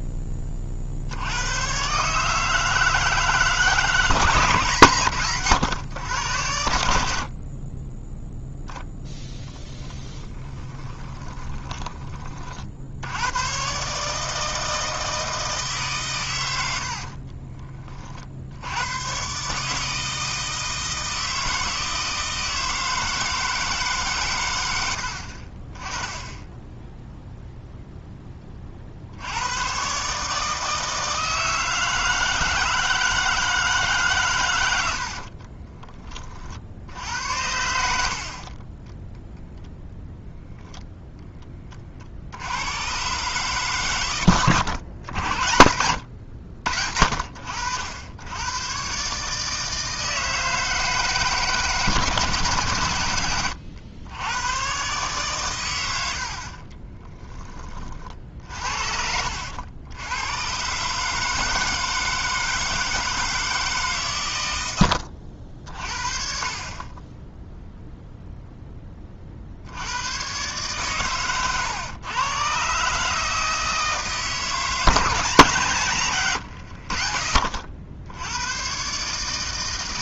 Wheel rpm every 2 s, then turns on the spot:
20, 150, 150, 110, 10, 10, 90, 160, 50, 110, 160, 160, 70, 10, 60, 160, 160, 70, 80, 10, 0, 100, 100, 70, 140, 160, 110, 130, 10, 60, 140, 160, 70, 20, 20, 130, 140, 160, 80, 140.
10-12 16-18 34-36 38-40 56-60